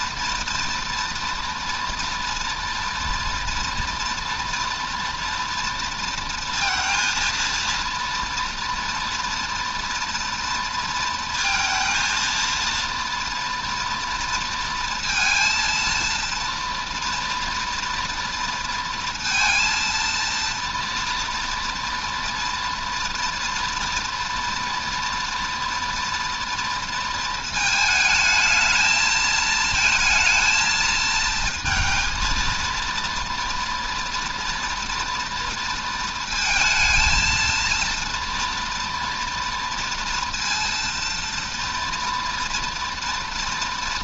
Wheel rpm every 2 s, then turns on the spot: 240, 240, 230, 230, 230, 230, 230, 230, 230, 230, 230, 230, 240, 230, 220, 220, 230, 240, 230, 230, 230, 240.
none